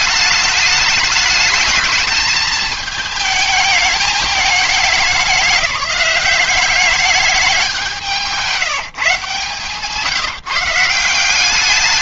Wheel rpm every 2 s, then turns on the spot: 210, 220, 210, 200, 160, 160.
none